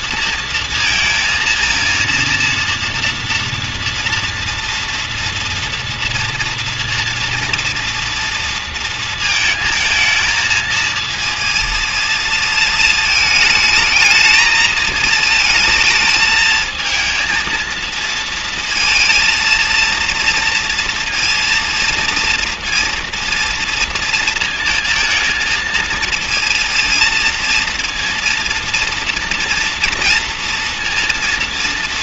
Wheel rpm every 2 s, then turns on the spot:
230, 230, 230, 230, 230, 220, 220, 220, 220, 230, 230, 230, 230, 230, 230, 230.
none